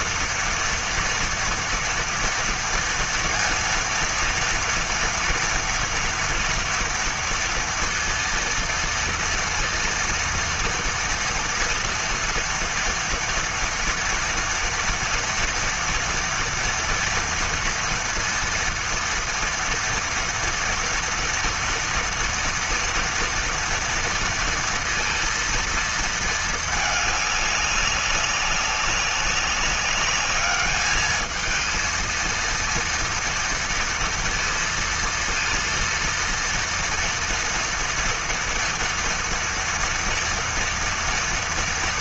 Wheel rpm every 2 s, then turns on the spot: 240, 230, 230, 230, 230, 230, 240, 230, 230, 230, 230, 230, 230, 220, 190, 210, 230, 230, 230, 230, 230.
none